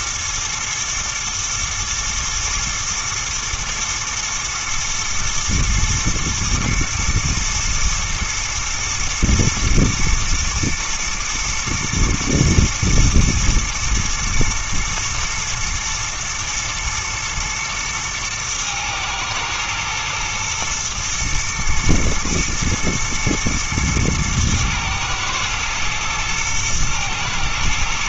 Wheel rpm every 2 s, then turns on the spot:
110, 110, 120, 120, 120, 120, 110, 110, 110, 110, 110, 120, 110, 110.
none